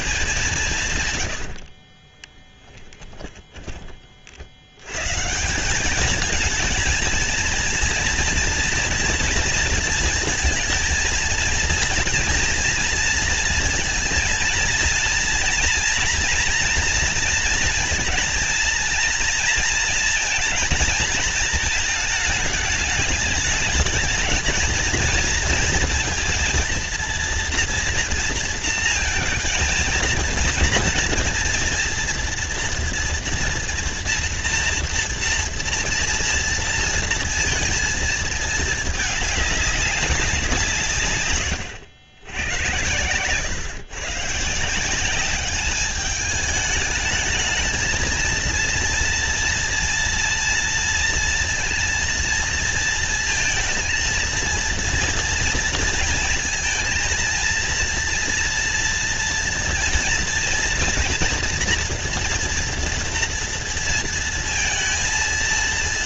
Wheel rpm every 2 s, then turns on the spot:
180, 10, 80, 210, 230, 230, 230, 230, 240, 230, 230, 220, 220, 230, 230, 230, 230, 230, 230, 220, 200, 80, 160, 210, 230, 230, 230, 230, 230, 240, 230, 230, 230.
2-4